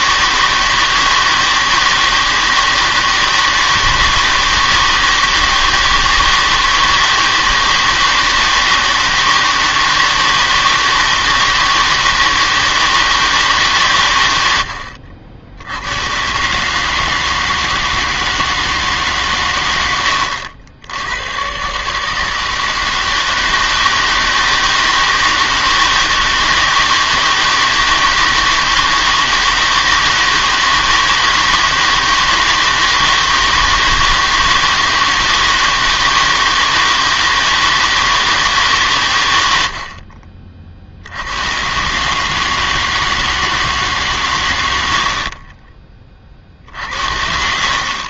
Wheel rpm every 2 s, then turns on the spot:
160, 160, 160, 160, 160, 160, 160, 80, 140, 160, 80, 160, 160, 160, 160, 160, 160, 160, 160, 140, 40, 160, 100, 50.
46-48